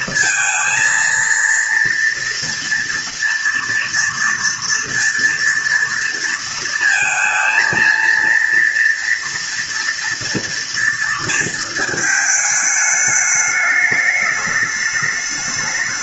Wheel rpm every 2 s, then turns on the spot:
230, 230, 230, 230, 230, 240, 220, 210.
none